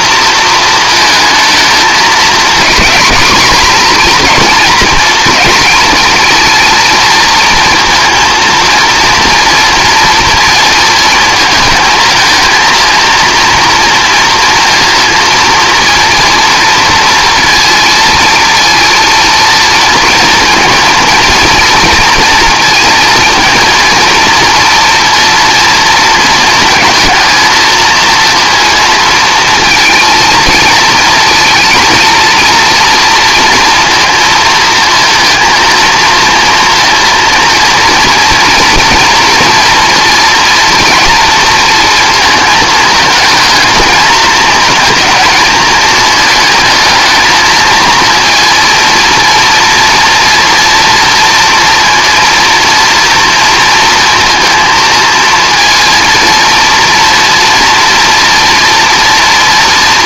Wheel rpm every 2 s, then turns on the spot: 220, 220, 230, 230, 230, 230, 230, 230, 230, 230, 230, 230, 240, 220, 230, 230, 230, 230, 230, 230, 230, 220, 220, 220, 230, 230, 230, 230, 230, 230.
none